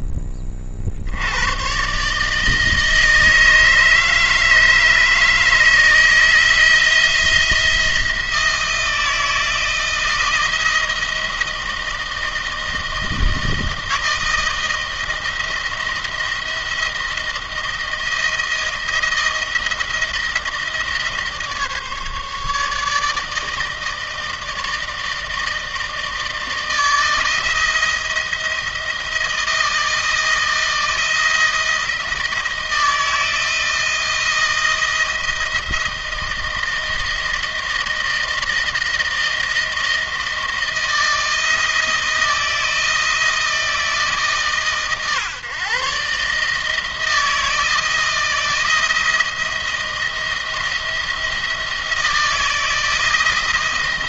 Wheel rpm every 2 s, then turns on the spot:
60, 160, 150, 160, 170, 160, 160, 160, 170, 160, 160, 150, 160, 160, 160, 160, 160, 170, 160, 160, 160, 170, 130, 160, 160, 170, 160.
none